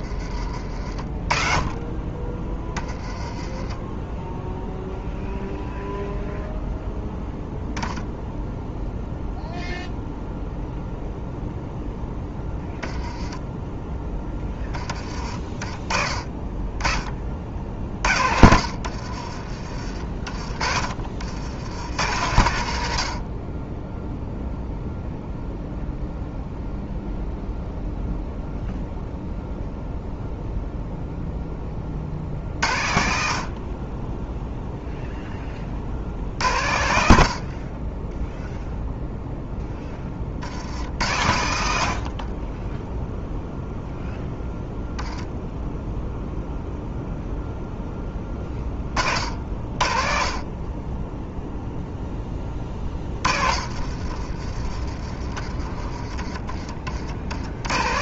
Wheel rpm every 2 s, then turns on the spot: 40, 20, 0, 0, 0, 0, 10, 20, 20, 60, 30, 90, 0, 0, 0, 0, 60, 0, 80, 0, 60, 10, 0, 0, 20, 30, 20, 40, 30.
0-2 12-14 18-22 52-54 56-58